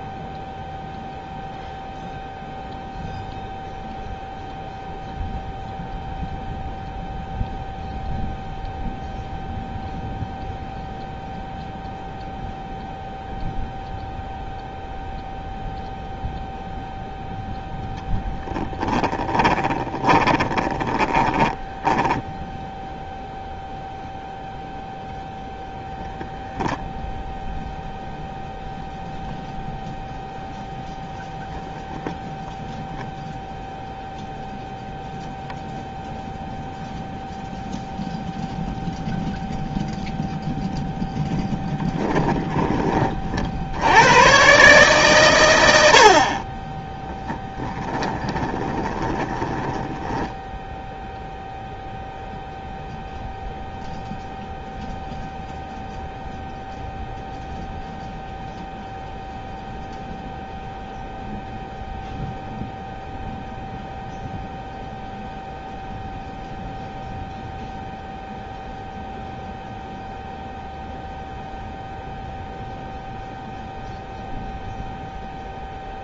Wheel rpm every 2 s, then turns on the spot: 0, 0, 0, 0, 0, 0, 0, 0, 0, 10, 20, 0, 0, 0, 0, 0, 0, 0, 0, 0, 0, 30, 140, 10, 20, 0, 0, 0, 0, 0, 0, 0, 0, 0, 0, 0, 0, 0.
18-22 48-50